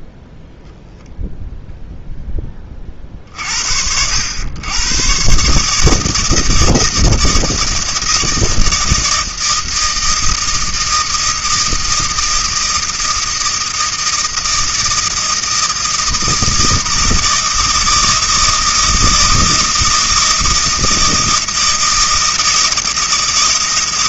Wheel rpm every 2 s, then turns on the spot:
0, 20, 110, 160, 160, 160, 160, 160, 160, 160, 160, 160.
none